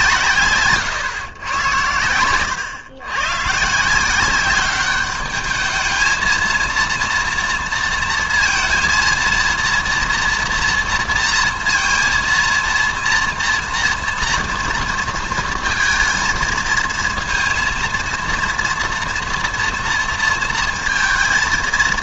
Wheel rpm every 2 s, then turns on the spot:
130, 110, 200, 230, 230, 230, 230, 230, 230, 230, 230.
none